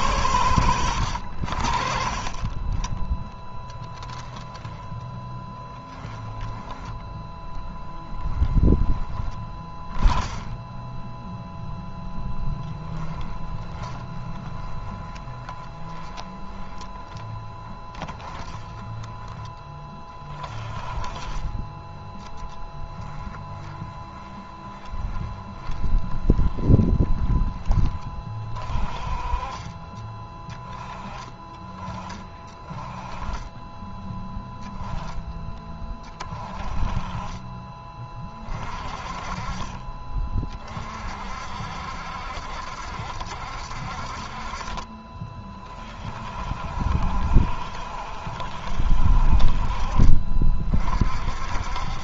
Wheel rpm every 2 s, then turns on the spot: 110, 20, 10, 10, 20, 10, 10, 20, 20, 20, 30, 20, 20, 20, 30, 20, 30, 20, 30, 30, 50, 80, 60, 60, 60, 50.
4-10 12-18 20-28